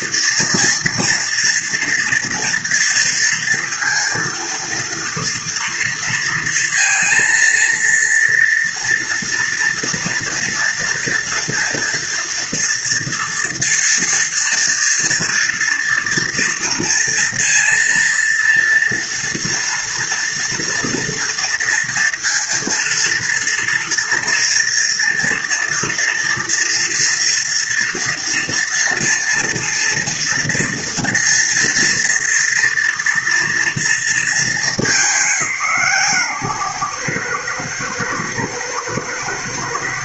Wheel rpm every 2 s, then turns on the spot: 230, 230, 230, 230, 230, 240, 230, 230, 230, 230, 230, 230, 230, 230, 230, 230, 230, 190, 130, 110.
none